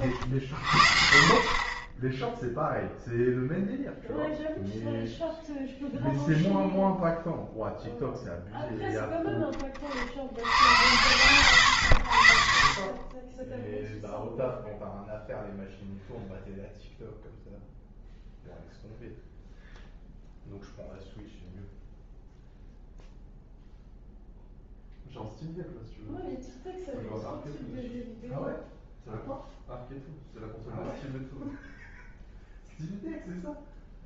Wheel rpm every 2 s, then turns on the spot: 60, 0, 0, 0, 0, 90, 50, 0, 0, 0, 0, 0, 0, 0, 0, 0, 0.
none